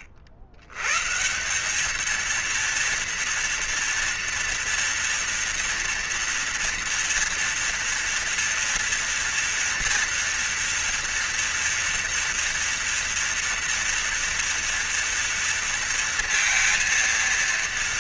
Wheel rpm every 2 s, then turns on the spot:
110, 230, 230, 230, 230, 230, 230, 230, 230.
none